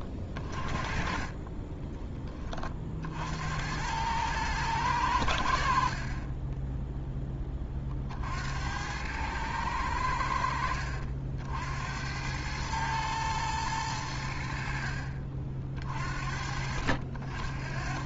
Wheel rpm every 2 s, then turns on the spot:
40, 60, 110, 10, 80, 70, 100, 70, 60.
6-8